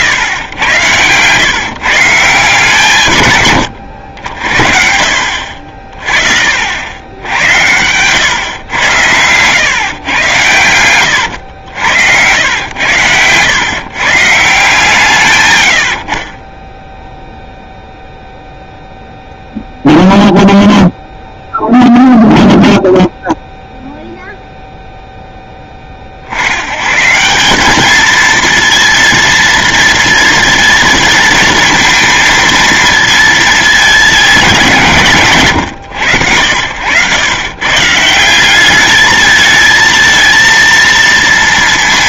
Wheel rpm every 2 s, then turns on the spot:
110, 130, 60, 70, 100, 110, 100, 150, 20, 0, 0, 0, 0, 90, 230, 230, 230, 180, 90, 190, 230.
none